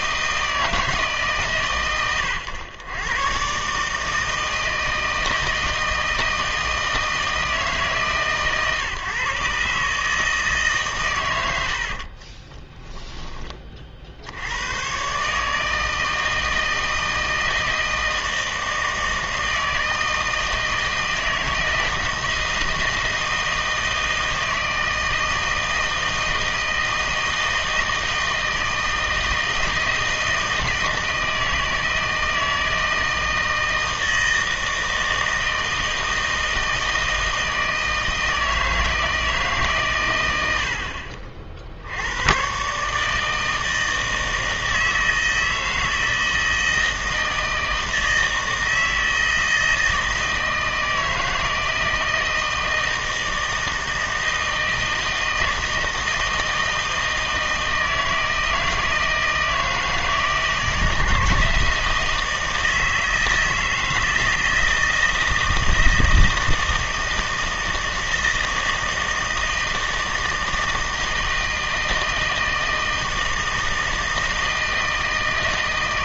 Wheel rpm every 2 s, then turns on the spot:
160, 110, 160, 160, 140, 140, 20, 100, 160, 160, 160, 160, 160, 160, 160, 160, 160, 160, 160, 160, 60, 130, 160, 160, 160, 160, 160, 160, 160, 160, 160, 160, 160, 160, 160, 160, 160, 160.
12-14